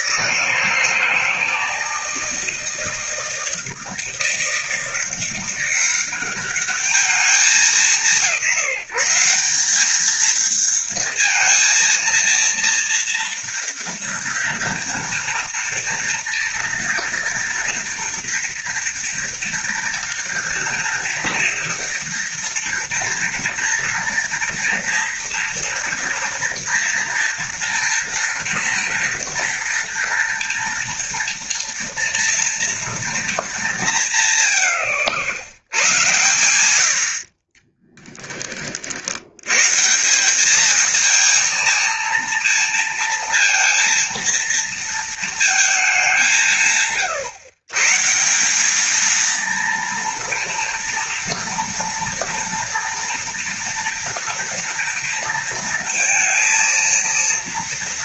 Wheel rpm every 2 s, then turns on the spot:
160, 160, 160, 210, 180, 230, 230, 230, 230, 230, 230, 230, 230, 230, 230, 230, 230, 80, 70, 50, 220, 230, 230, 150, 210, 230, 230, 230, 230.
none